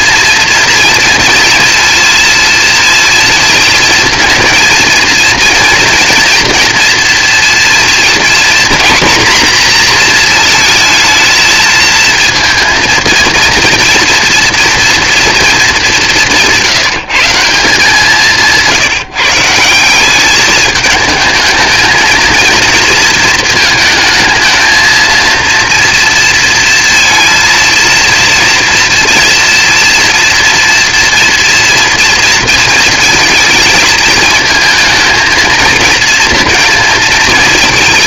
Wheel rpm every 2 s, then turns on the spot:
230, 230, 230, 230, 240, 220, 230, 230, 170, 160, 210, 230, 220, 230, 230, 230, 230, 220, 230.
none